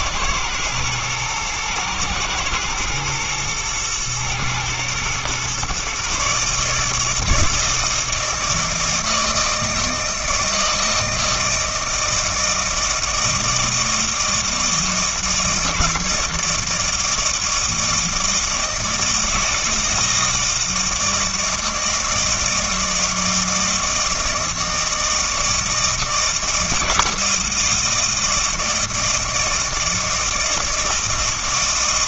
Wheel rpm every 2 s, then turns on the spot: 120, 120, 120, 150, 160, 160, 160, 160, 160, 160, 160, 160, 160, 160, 160, 160.
none